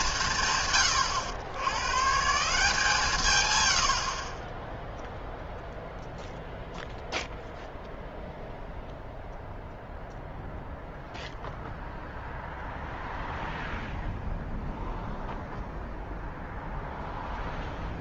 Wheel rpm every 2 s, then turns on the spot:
140, 160, 10, 0, 0, 0, 0, 0, 0.
none